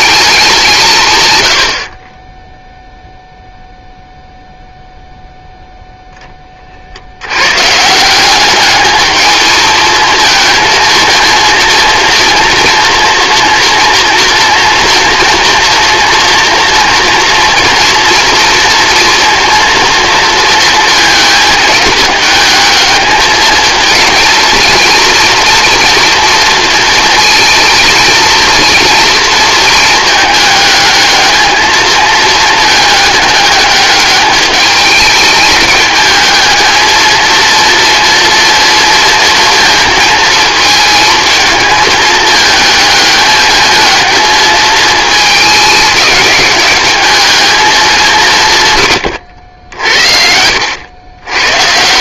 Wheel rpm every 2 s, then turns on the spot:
160, 0, 0, 40, 200, 230, 230, 230, 240, 230, 220, 210, 230, 230, 240, 210, 210, 210, 220, 230, 220, 210, 220, 210, 140, 70.
none